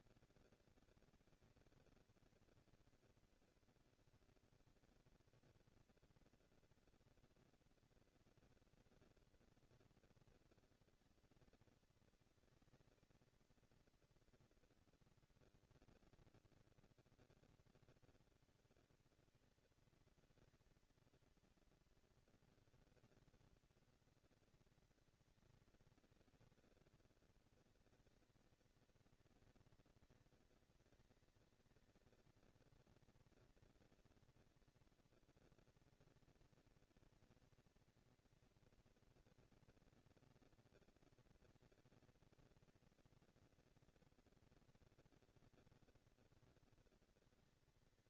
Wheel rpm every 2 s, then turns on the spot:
230, 230, 230, 230, 230, 230, 220, 230, 220, 210, 230, 220, 200, 200, 220, 230, 230, 230, 230, 230, 230, 230, 230, 230.
none